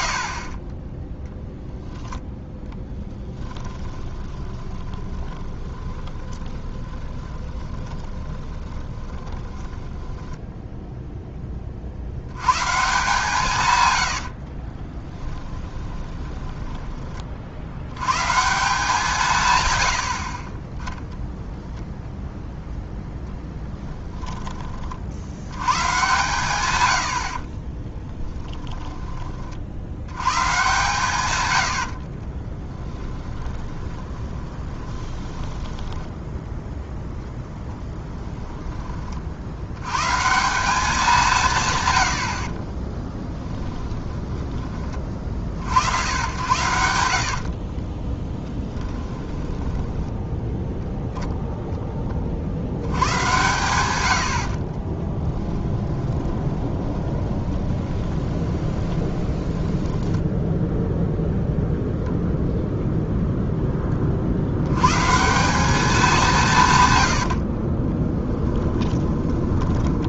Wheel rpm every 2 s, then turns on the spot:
60, 10, 20, 20, 20, 10, 100, 60, 20, 140, 50, 0, 20, 120, 20, 110, 30, 20, 0, 10, 160, 60, 20, 90, 20, 10, 40, 80, 20, 20, 10, 0, 60, 180, 20.
4-10 14-18 24-26 28-30 32-36 44-46 48-50 56-62 68-70